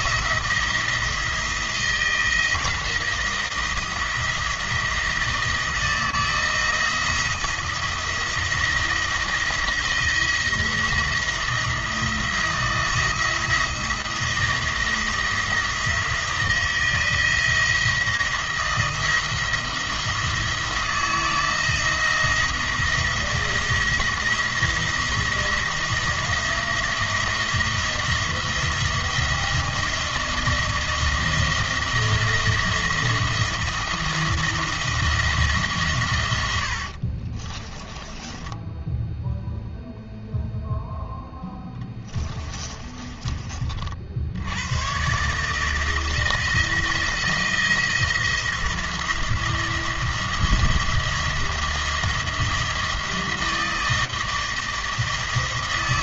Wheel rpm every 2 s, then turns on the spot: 170, 170, 170, 170, 170, 170, 160, 170, 170, 170, 160, 170, 170, 170, 170, 170, 170, 170, 70, 10, 0, 20, 120, 160, 170, 170, 160, 160.
36-40 42-44